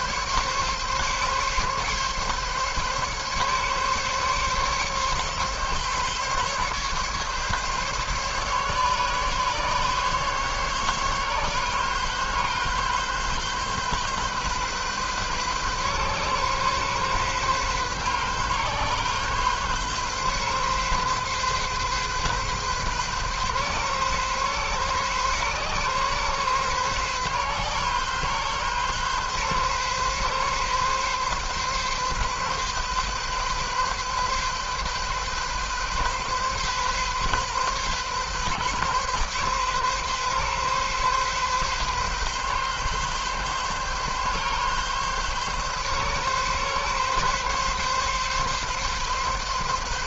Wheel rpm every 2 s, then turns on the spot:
140, 140, 140, 140, 140, 140, 130, 130, 130, 130, 130, 130, 130, 130, 130, 130, 130, 130, 130, 130, 130, 130, 130, 140, 140.
none